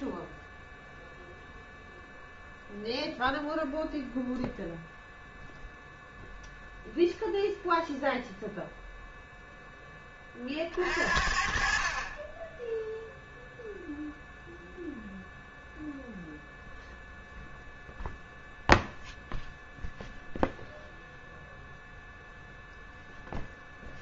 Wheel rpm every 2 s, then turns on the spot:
0, 0, 0, 0, 0, 40, 10, 0, 0, 0, 0, 0.
none